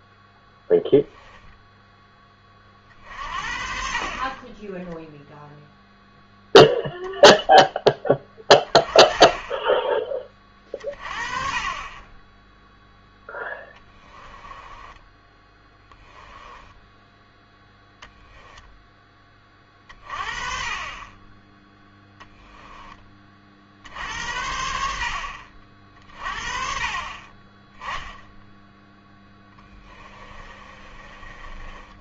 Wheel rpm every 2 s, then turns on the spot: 0, 50, 10, 0, 20, 30, 0, 10, 10, 10, 30, 10, 70, 40, 10, 30.
14-18 30-32